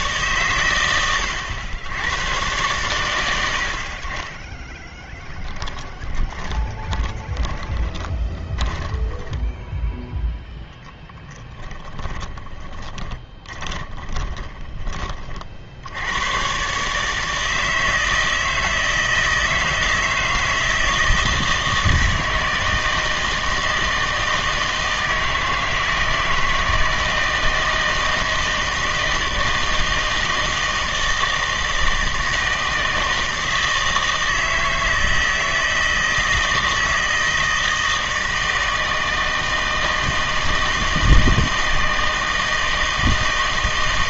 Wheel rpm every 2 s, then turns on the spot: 110, 120, 20, 20, 30, 0, 20, 20, 130, 160, 160, 160, 160, 160, 160, 160, 160, 160, 160, 160, 160, 160.
4-10 12-16